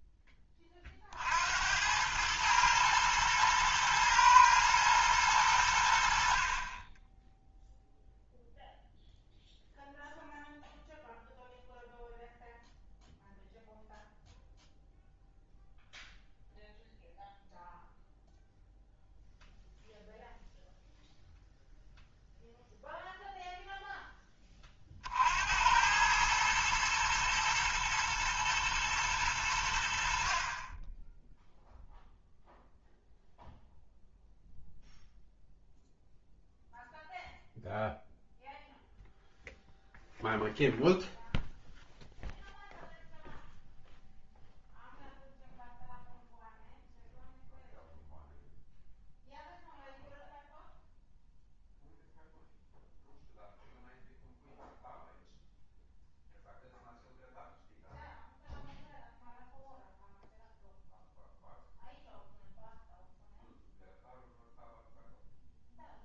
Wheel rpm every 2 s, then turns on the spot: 30, 110, 110, 30, 0, 0, 0, 0, 0, 0, 0, 0, 30, 110, 120, 30, 0, 0, 0, 0, 0, 0, 0, 0, 0, 0, 0, 0, 0, 0, 0, 0, 0.
none